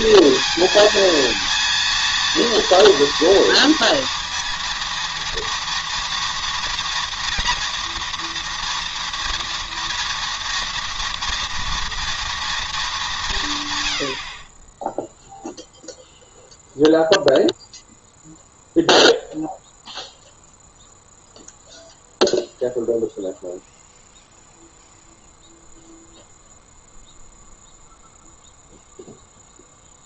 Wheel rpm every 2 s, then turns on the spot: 230, 230, 230, 230, 230, 230, 210, 20, 0, 0, 0, 0, 0, 0, 0.
none